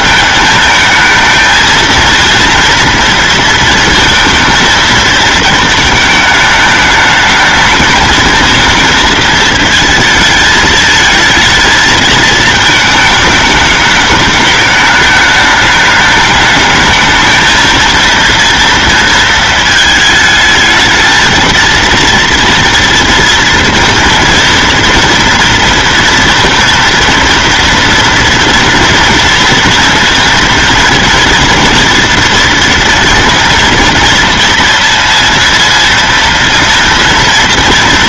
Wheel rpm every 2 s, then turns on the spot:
220, 230, 220, 210, 220, 220, 220, 210, 220, 230, 220, 230, 230, 230, 230, 230, 230, 230, 230.
none